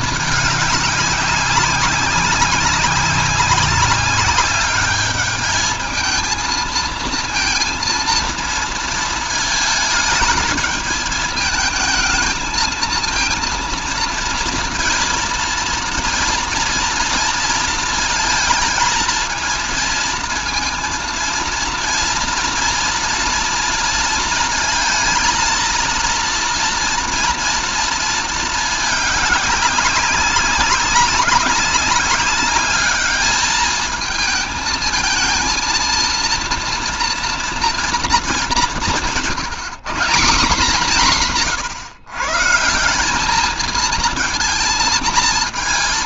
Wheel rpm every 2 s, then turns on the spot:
200, 190, 210, 230, 220, 220, 220, 230, 230, 230, 230, 240, 230, 230, 220, 190, 210, 230, 230, 190, 180, 180, 230.
none